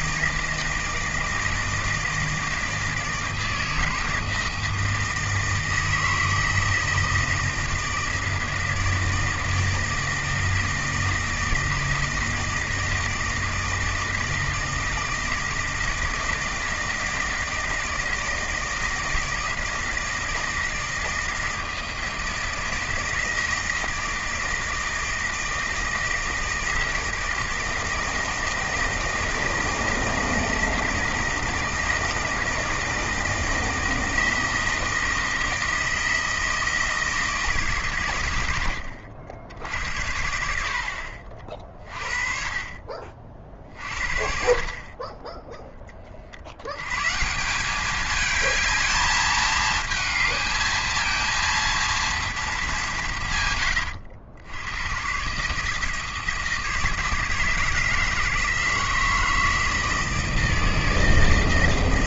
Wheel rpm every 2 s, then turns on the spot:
160, 160, 160, 160, 160, 160, 160, 160, 160, 160, 160, 160, 160, 160, 160, 160, 160, 160, 160, 90, 60, 40, 50, 90, 220, 220, 210, 90, 160, 160, 160.
none